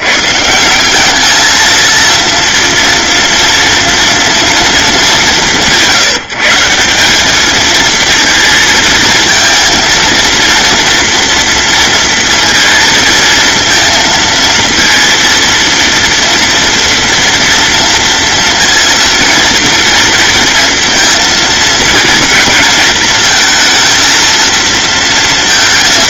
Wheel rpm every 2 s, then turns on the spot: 200, 230, 210, 190, 220, 230, 230, 230, 230, 230, 230, 220, 230.
none